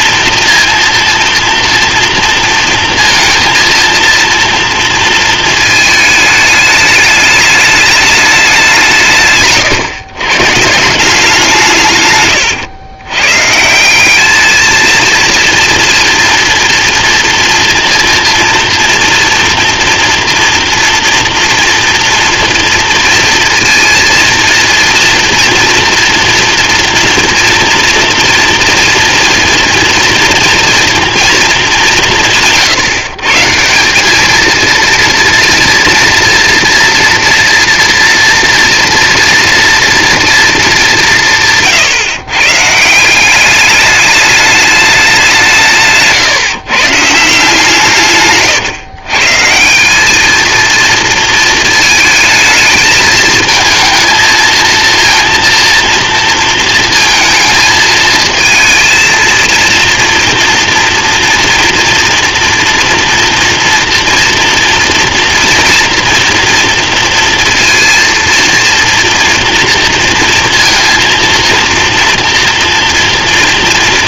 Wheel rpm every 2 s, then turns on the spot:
230, 230, 230, 210, 160, 170, 120, 230, 230, 230, 230, 230, 230, 230, 230, 230, 150, 230, 230, 230, 180, 180, 190, 150, 150, 230, 220, 230, 230, 230, 230, 230, 230, 230, 230, 230, 230.
none